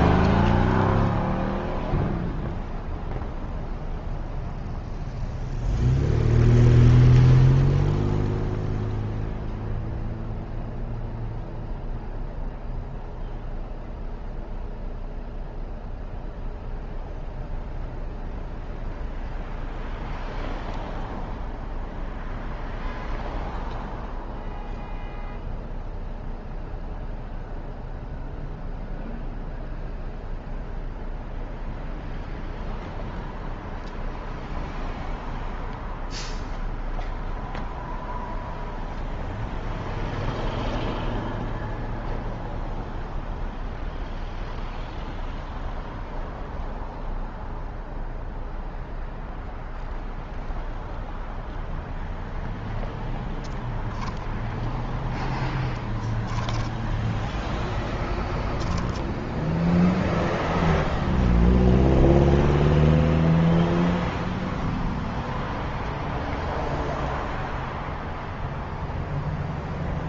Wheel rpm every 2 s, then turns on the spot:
0, 0, 0, 0, 0, 0, 0, 0, 0, 0, 0, 0, 0, 0, 0, 0, 0, 0, 0, 0, 0, 0, 0, 0, 0, 0, 0, 0, 0, 10, 0, 0, 0, 0, 0.
none